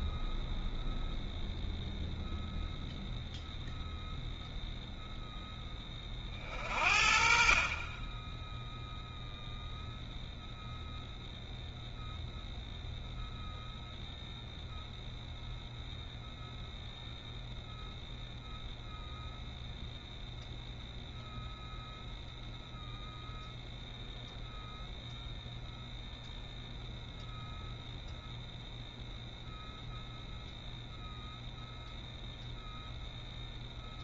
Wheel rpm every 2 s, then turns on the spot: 0, 0, 0, 40, 0, 0, 0, 0, 0, 0, 0, 0, 0, 0, 0, 0, 0.
none